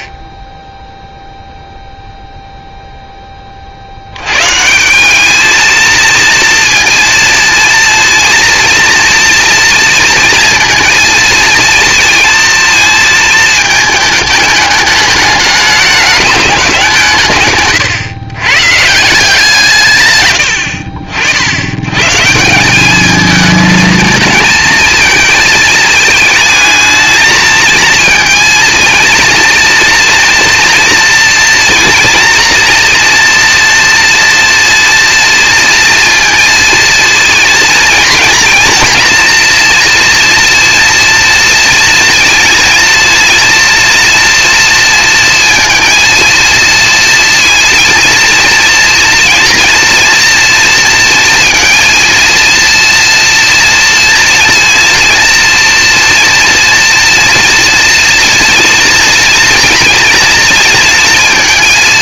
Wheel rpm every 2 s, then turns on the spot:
10, 0, 140, 230, 230, 230, 220, 210, 200, 140, 80, 180, 230, 220, 230, 230, 230, 230, 230, 230, 230, 230, 240, 230, 230, 230, 230, 230, 230, 230, 230.
20-22